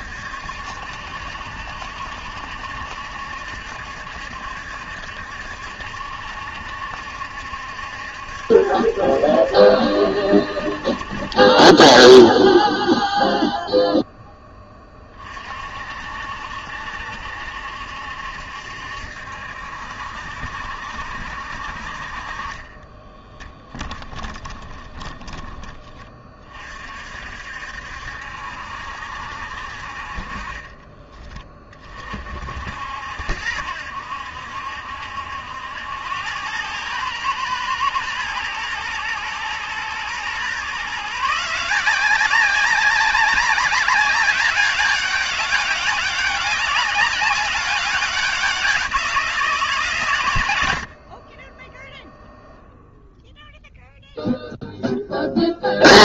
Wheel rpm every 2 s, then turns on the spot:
70, 70, 60, 70, 70, 50, 0, 20, 70, 70, 70, 20, 20, 50, 70, 20, 70, 70, 110, 110, 140, 200, 200, 190, 180, 70, 0, 10.
22-26 30-32